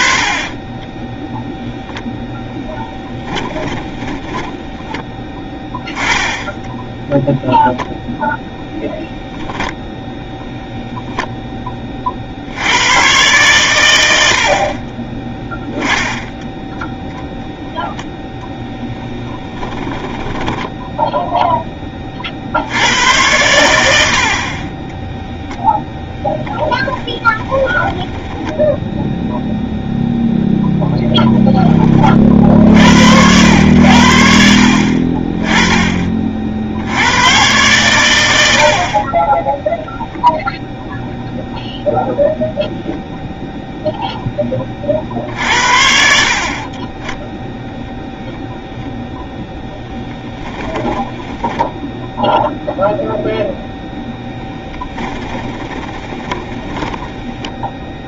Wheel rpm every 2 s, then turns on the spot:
50, 10, 10, 10, 0, 0, 90, 40, 0, 10, 10, 90, 20, 10, 0, 0, 60, 40, 60, 60, 0, 0, 20, 30, 0, 10, 0, 10, 30.
18-22 50-52 54-58